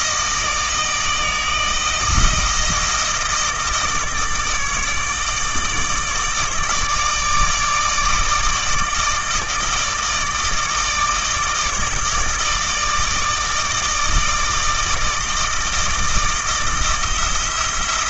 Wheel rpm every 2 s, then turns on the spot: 160, 160, 150, 150, 160, 160, 160, 160, 160.
none